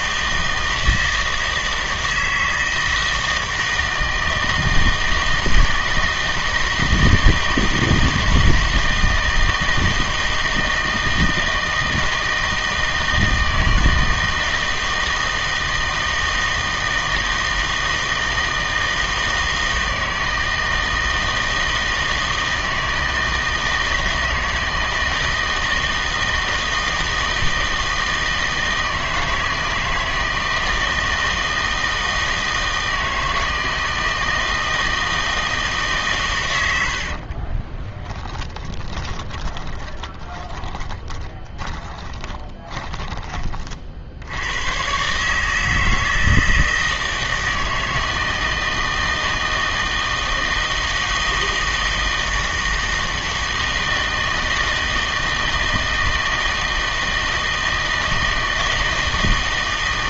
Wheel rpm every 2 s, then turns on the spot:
160, 160, 160, 160, 160, 160, 160, 160, 160, 160, 160, 160, 160, 160, 160, 160, 160, 160, 100, 30, 20, 20, 110, 160, 160, 160, 160, 160, 160, 160.
36-44